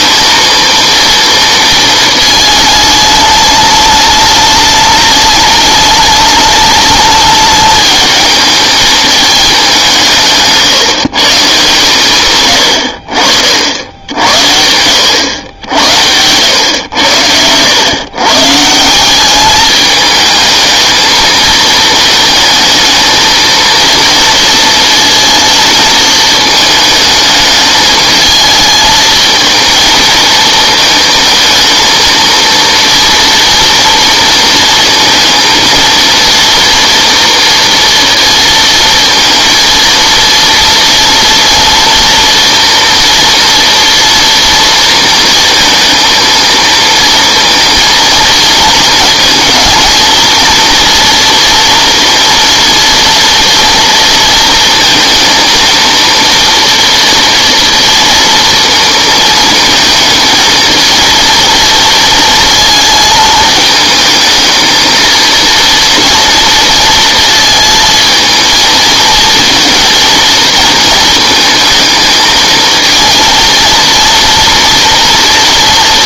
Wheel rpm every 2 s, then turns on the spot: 230, 220, 210, 210, 220, 160, 80, 80, 100, 170, 220, 230, 220, 220, 220, 220, 230, 230, 230, 230, 230, 240, 230, 230, 230, 230, 230, 230, 230, 230, 230, 220, 230, 230, 230, 230, 220, 230.
none